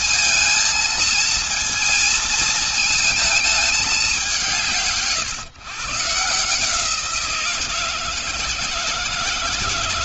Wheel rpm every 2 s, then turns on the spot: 230, 230, 170, 160, 160.
none